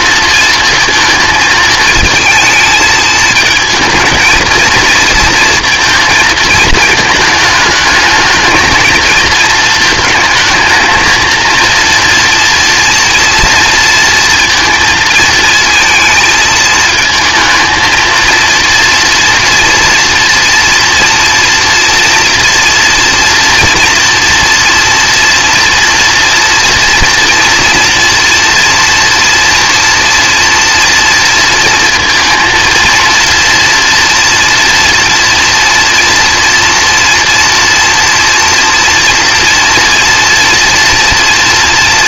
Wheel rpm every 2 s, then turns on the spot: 230, 220, 230, 220, 220, 220, 230, 230, 220, 230, 240, 240, 230, 230, 230, 230, 230, 230, 240, 230, 240.
none